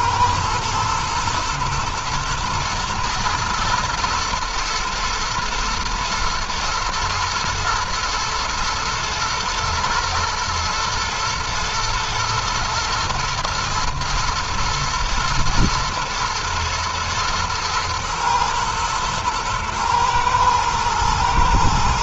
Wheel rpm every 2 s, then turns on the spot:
120, 110, 120, 120, 120, 120, 120, 120, 120, 110, 110.
none